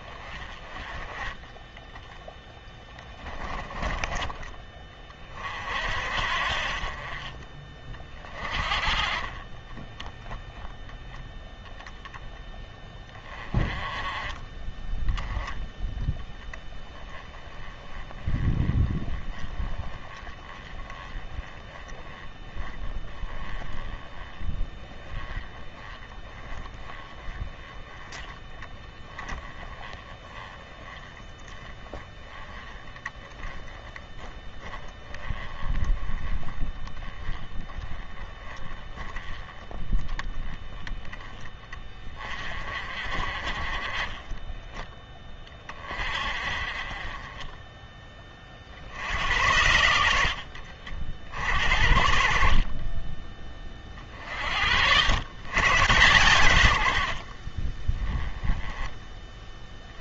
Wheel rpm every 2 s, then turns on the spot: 20, 10, 30, 40, 30, 10, 20, 10, 10, 10, 10, 10, 10, 10, 20, 10, 10, 10, 10, 10, 20, 40, 10, 30, 70, 50, 20, 80, 80, 10.
2-4